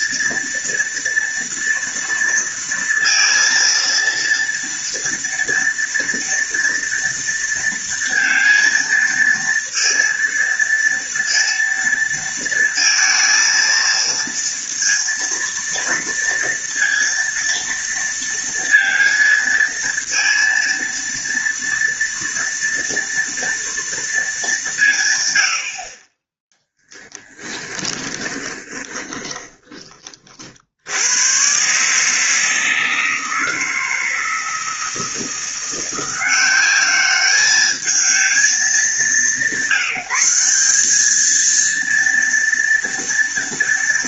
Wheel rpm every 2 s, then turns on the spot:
230, 230, 230, 230, 230, 230, 230, 230, 230, 230, 230, 230, 170, 10, 20, 70, 160, 160, 190, 210, 200, 230.
28-30